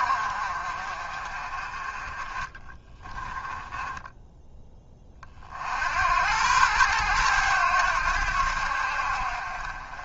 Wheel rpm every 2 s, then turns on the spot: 40, 20, 30, 110, 70.
2-4